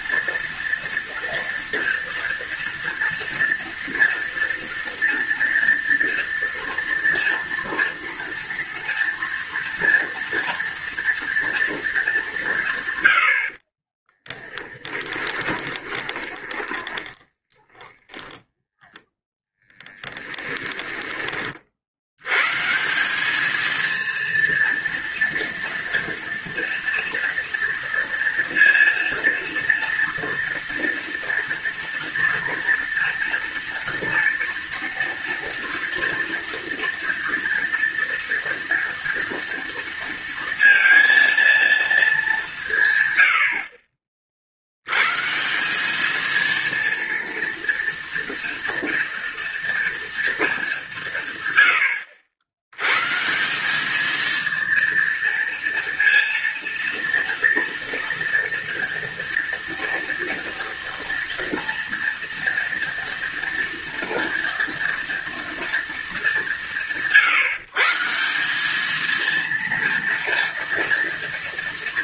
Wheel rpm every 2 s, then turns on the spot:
230, 230, 230, 230, 230, 230, 160, 20, 10, 0, 10, 150, 230, 230, 230, 230, 230, 230, 230, 240, 230, 170, 70, 230, 230, 210, 100, 230, 230, 230, 230, 240, 230, 170, 200, 230.
14-18 20-22